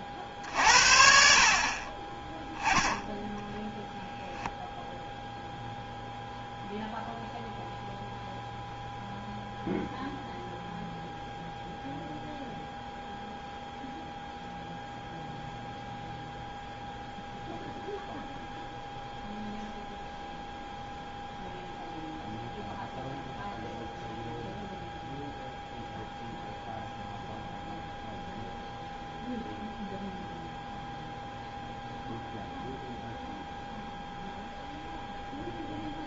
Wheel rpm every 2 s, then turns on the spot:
50, 10, 0, 0, 0, 0, 0, 0, 0, 0, 0, 0, 0, 0, 0, 0, 0, 0.
none